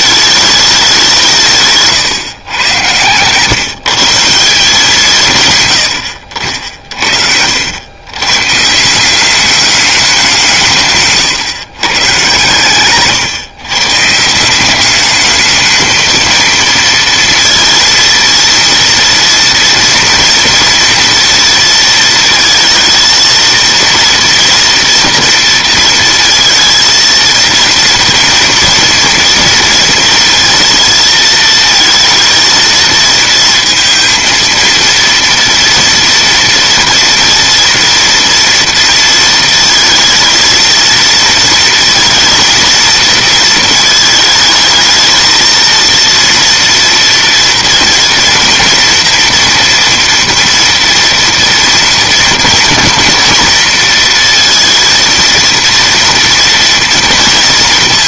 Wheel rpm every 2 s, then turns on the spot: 200, 120, 170, 60, 150, 150, 130, 190, 230, 230, 230, 220, 230, 230, 230, 230, 220, 230, 230, 230, 230, 230, 220, 230, 230, 230, 230, 230, 230.
6-8